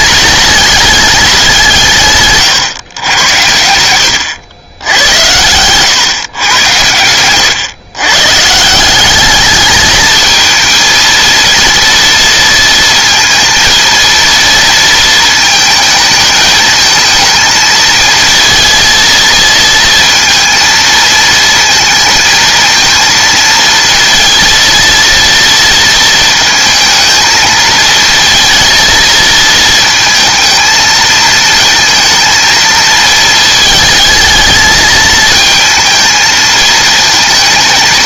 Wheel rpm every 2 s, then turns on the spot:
210, 130, 90, 100, 160, 230, 230, 230, 220, 230, 230, 230, 230, 230, 230, 220, 220, 220, 220.
none